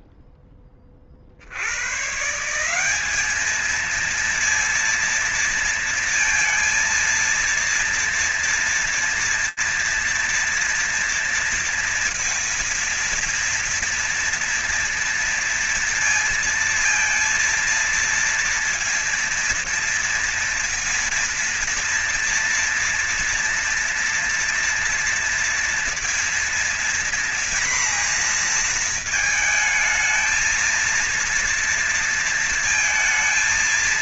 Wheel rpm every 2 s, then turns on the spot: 0, 130, 230, 230, 230, 230, 230, 230, 230, 230, 230, 230, 230, 230, 230, 230, 230.
none